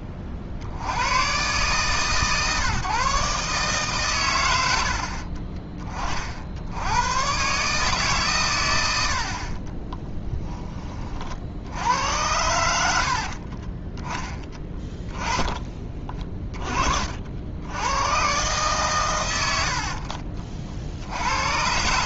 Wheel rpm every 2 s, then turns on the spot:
50, 150, 100, 70, 110, 10, 90, 20, 30, 120, 50.
14-16